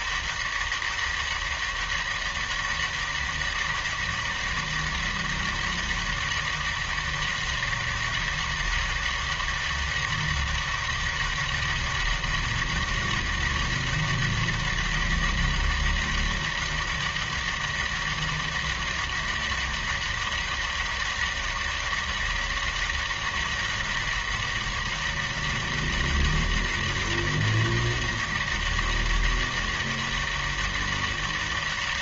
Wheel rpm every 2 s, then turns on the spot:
200, 200, 200, 200, 200, 200, 200, 200, 200, 200, 200, 200, 200, 200, 200, 200.
none